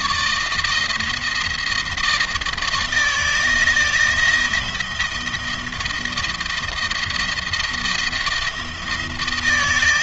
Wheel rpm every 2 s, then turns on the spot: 160, 160, 170, 170, 160.
none